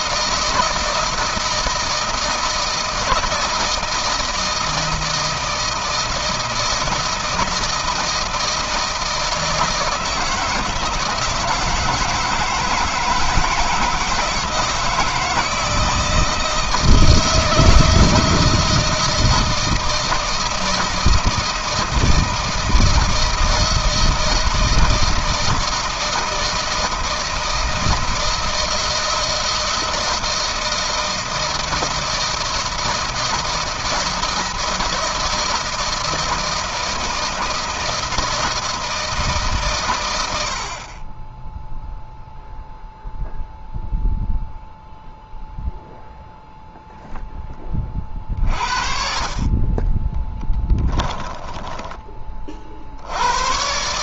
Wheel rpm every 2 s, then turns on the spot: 160, 160, 160, 160, 160, 160, 160, 160, 160, 160, 160, 160, 160, 160, 160, 160, 170, 160, 160, 160, 60, 0, 0, 0, 30, 10, 30.
50-52